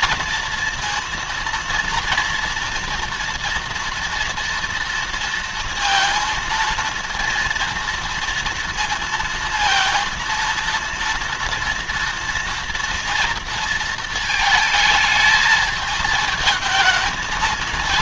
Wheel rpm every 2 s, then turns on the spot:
230, 230, 230, 230, 230, 230, 230, 220, 220.
none